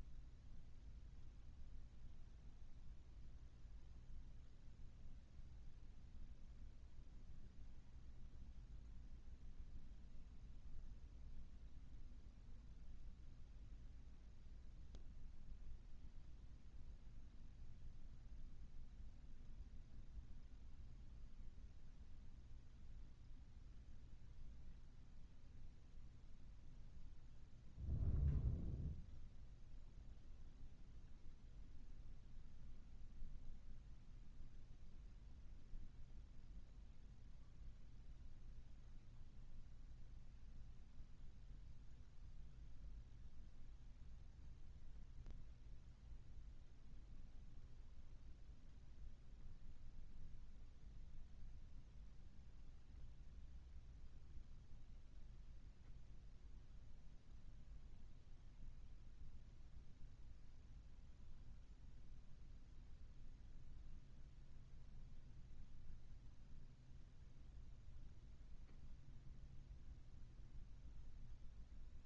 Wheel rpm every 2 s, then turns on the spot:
0, 0, 0, 0, 0, 0, 0, 0, 0, 0, 0, 0, 0, 0, 0, 0, 0, 0, 0, 0, 0, 0, 0, 0, 0, 0, 0, 0, 0, 0, 0, 0, 0, 0, 0, 0.
none